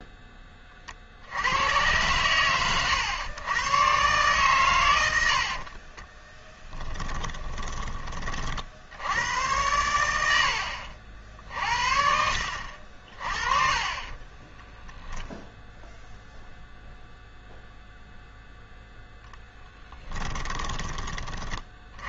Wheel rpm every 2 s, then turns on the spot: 50, 110, 100, 20, 70, 60, 60, 0, 0, 0, 20.
6-8